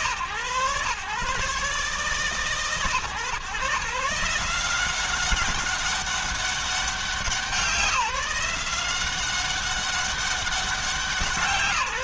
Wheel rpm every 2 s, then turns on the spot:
130, 140, 180, 190, 180, 180.
none